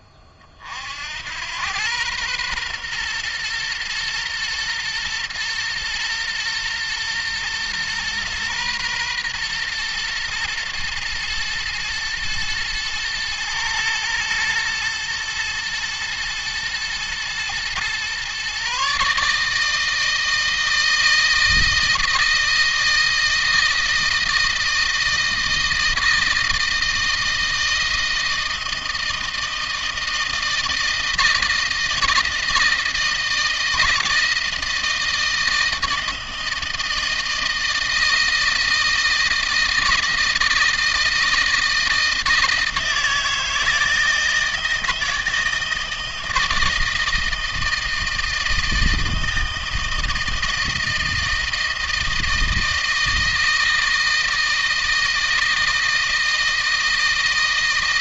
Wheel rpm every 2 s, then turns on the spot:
60, 120, 120, 120, 120, 120, 110, 110, 120, 140, 160, 160, 160, 160, 160, 160, 160, 160, 160, 160, 160, 160, 160, 160, 160, 160, 160, 160, 160.
none